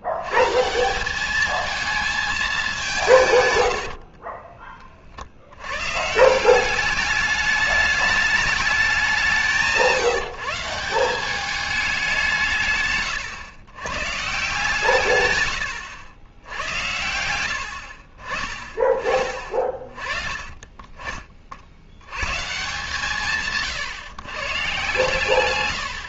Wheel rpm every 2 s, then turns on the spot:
140, 210, 40, 180, 210, 170, 160, 140, 90, 30, 30, 130, 140.
4-6